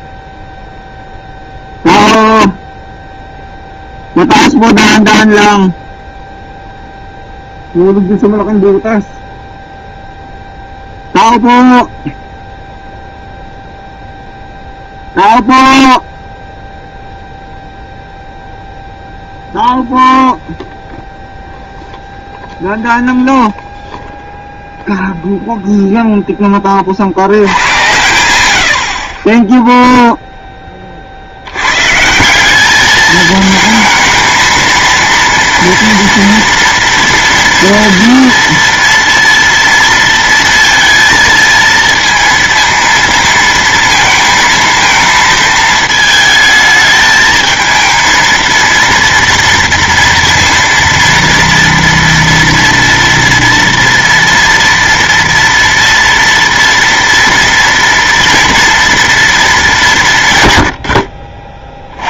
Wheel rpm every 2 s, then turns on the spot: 0, 0, 0, 0, 0, 0, 0, 0, 0, 0, 0, 0, 0, 30, 80, 20, 210, 230, 240, 230, 230, 230, 220, 220, 230, 230, 230, 230, 230, 240, 90.
none